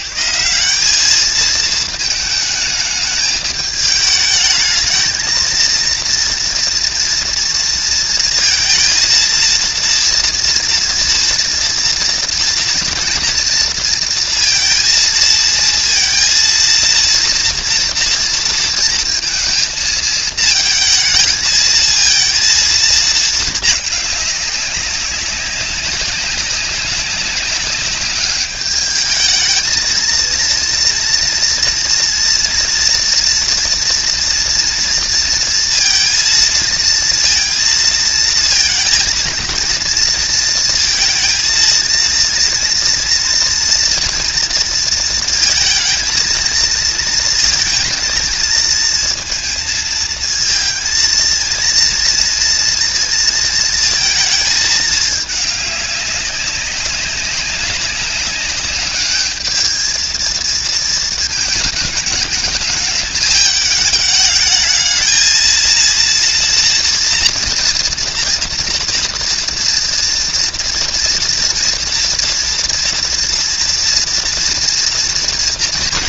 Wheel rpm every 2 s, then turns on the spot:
180, 220, 220, 230, 230, 230, 230, 230, 230, 230, 230, 230, 200, 200, 210, 230, 230, 230, 230, 230, 230, 230, 230, 230, 230, 230, 230, 220, 200, 210, 230, 220, 210, 230, 230, 230, 230, 230.
none